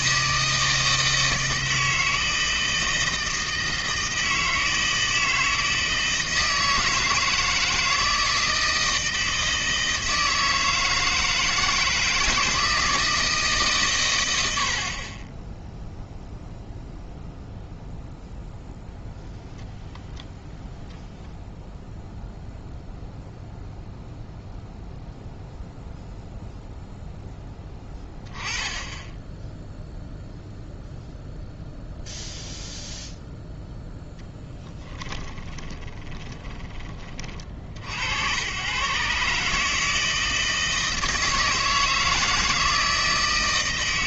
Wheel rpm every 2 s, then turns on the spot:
160, 160, 160, 160, 160, 160, 160, 40, 0, 0, 10, 0, 0, 0, 10, 0, 0, 10, 30, 120, 160, 160.
34-36